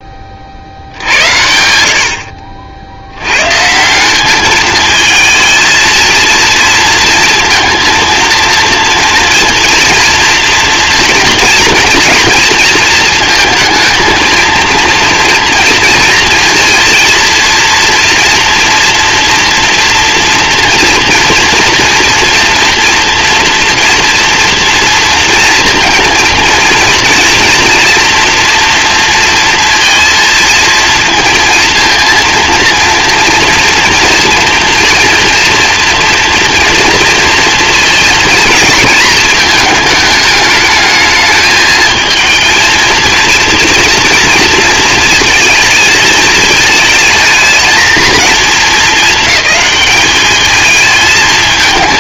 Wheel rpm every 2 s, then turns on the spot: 70, 70, 210, 230, 230, 230, 230, 230, 230, 230, 240, 230, 230, 230, 240, 230, 230, 230, 230, 230, 210, 230, 220, 220, 220, 220.
none